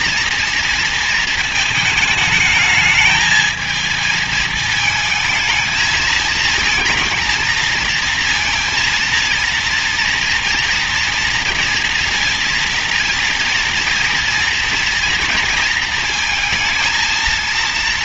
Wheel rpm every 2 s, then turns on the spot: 230, 220, 220, 230, 230, 240, 230, 230, 230.
none